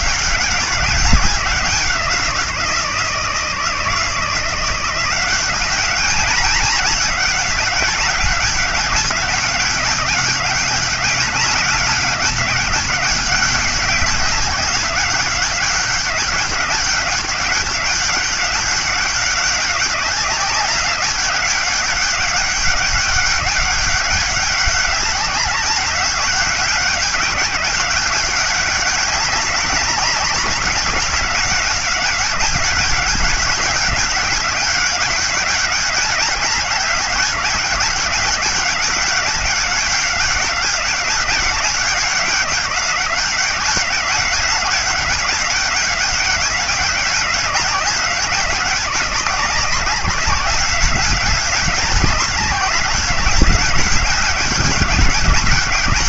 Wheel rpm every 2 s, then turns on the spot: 190, 170, 170, 200, 200, 200, 200, 190, 200, 200, 190, 200, 200, 200, 200, 200, 200, 200, 200, 200, 200, 190, 200, 190, 190, 190, 200, 200.
none